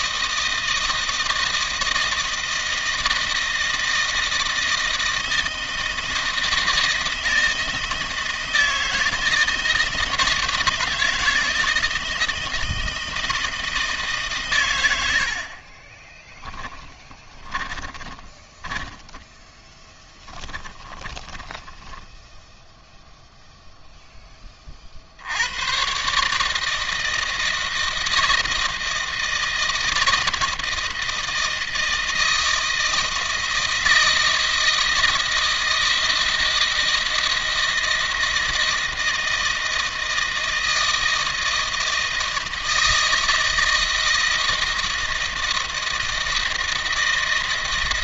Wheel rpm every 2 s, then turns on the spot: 160, 160, 160, 160, 160, 160, 160, 120, 10, 10, 10, 10, 30, 150, 160, 160, 160, 160, 160, 160, 160, 160, 160, 160.
16-24